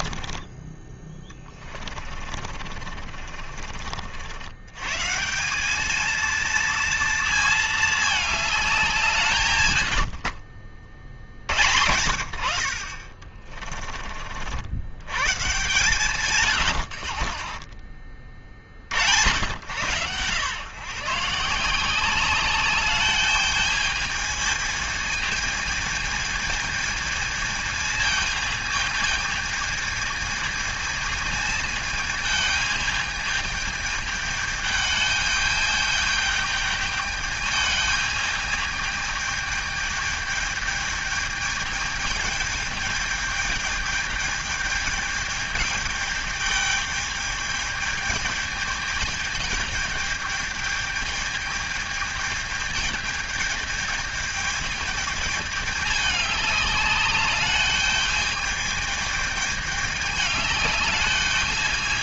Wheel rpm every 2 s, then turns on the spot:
20, 50, 120, 230, 190, 50, 60, 70, 110, 60, 130, 200, 220, 220, 220, 220, 210, 210, 210, 210, 210, 210, 210, 210, 220, 210, 220, 220, 200, 210, 210.
0-4 16-18